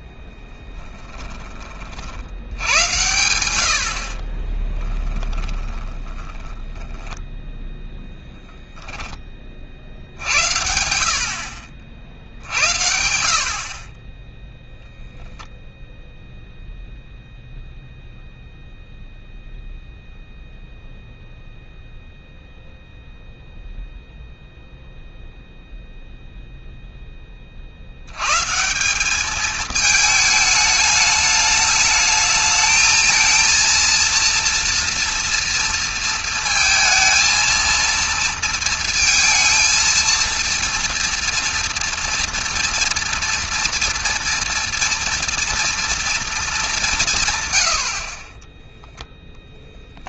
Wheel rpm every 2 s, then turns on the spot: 10, 100, 20, 10, 10, 70, 60, 10, 0, 0, 0, 0, 0, 0, 170, 210, 220, 230, 230, 230, 230, 230, 230, 200, 10.
4-8 48-50